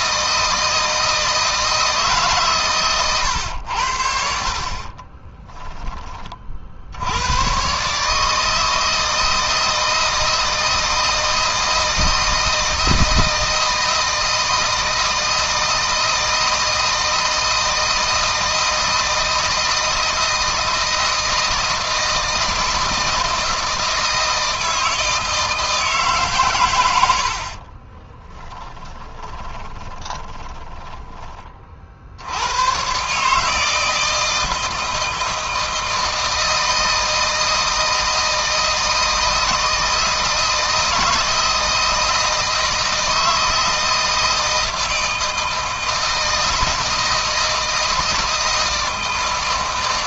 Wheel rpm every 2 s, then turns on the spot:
160, 130, 40, 60, 160, 160, 160, 160, 160, 160, 160, 160, 160, 110, 20, 20, 120, 160, 160, 160, 160, 160, 160, 160, 160.
2-6 26-30